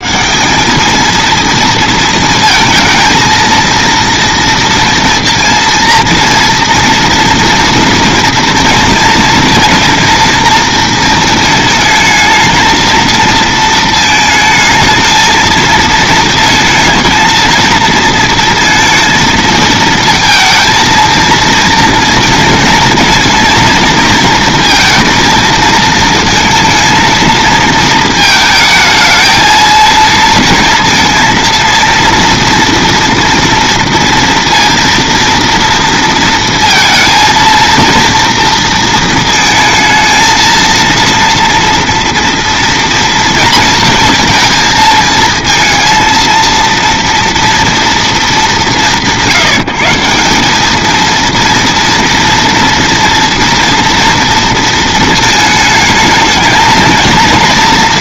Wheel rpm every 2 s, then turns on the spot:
200, 230, 240, 240, 230, 230, 220, 220, 220, 230, 230, 230, 230, 230, 220, 230, 230, 230, 230, 230, 230, 230, 230, 230, 200, 210, 230, 230, 230.
none